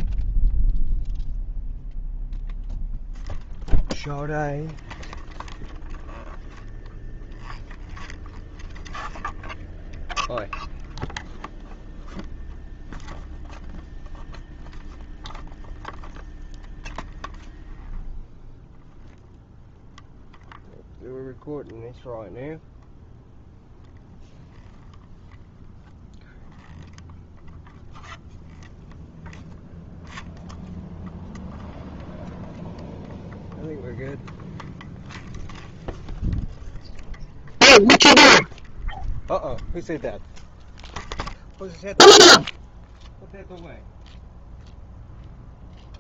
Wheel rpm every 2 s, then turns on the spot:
0, 0, 0, 0, 0, 0, 0, 0, 0, 0, 0, 0, 0, 0, 0, 0, 0, 0, 0, 0, 0, 0, 0.
none